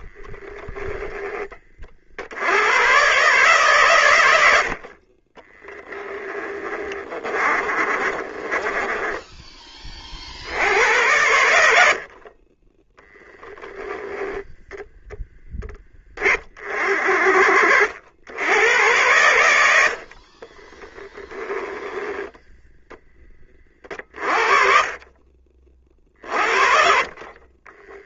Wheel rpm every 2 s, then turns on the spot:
10, 120, 40, 20, 20, 90, 10, 0, 40, 90, 20, 10, 40, 40.
6-10 12-14 20-22